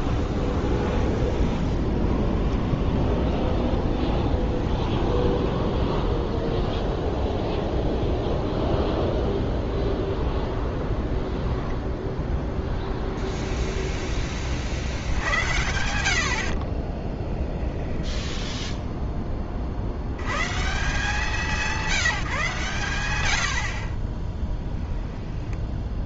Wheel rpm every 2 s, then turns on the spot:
0, 0, 0, 0, 0, 0, 0, 40, 50, 10, 140, 130, 10.
18-20 24-26